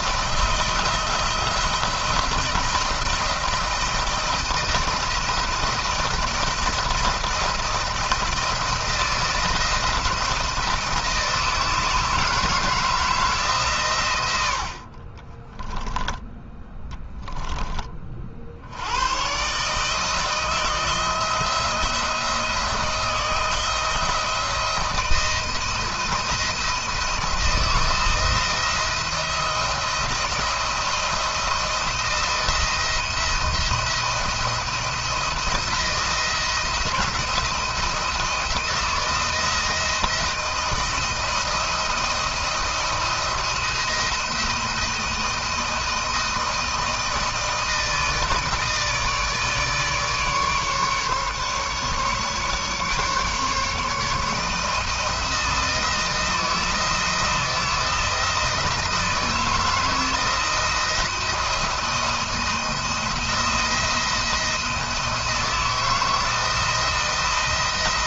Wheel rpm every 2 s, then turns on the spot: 160, 160, 160, 170, 170, 160, 160, 80, 0, 80, 160, 170, 170, 170, 170, 170, 170, 170, 170, 170, 170, 170, 170, 160, 160, 150, 140, 160, 170, 160, 160, 170, 170, 160.
none